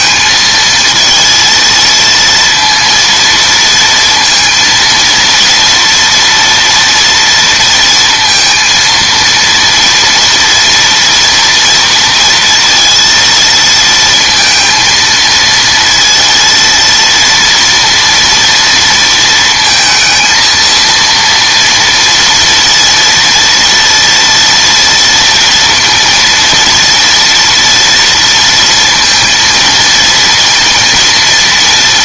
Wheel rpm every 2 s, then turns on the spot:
220, 230, 230, 230, 230, 230, 230, 230, 230, 230, 230, 230, 230, 230, 230, 230.
none